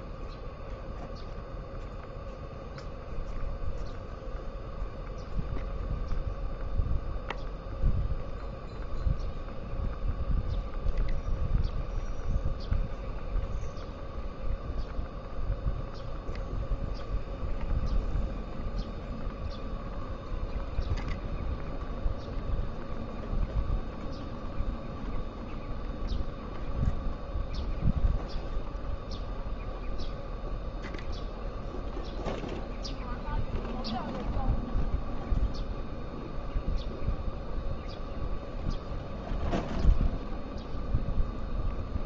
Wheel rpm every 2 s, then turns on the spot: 0, 0, 0, 0, 0, 0, 0, 0, 0, 0, 0, 0, 0, 0, 0, 0, 0, 0, 0, 0, 0.
none